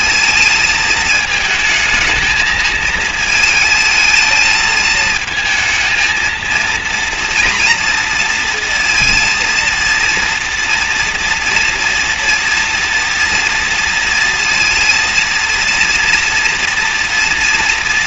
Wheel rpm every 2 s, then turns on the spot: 220, 220, 220, 230, 230, 230, 230, 230, 230.
none